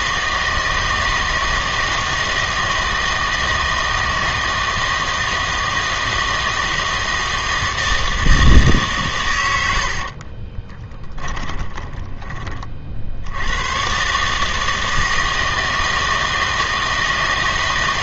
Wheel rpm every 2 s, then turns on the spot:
160, 160, 160, 160, 150, 30, 40, 160, 160.
10-12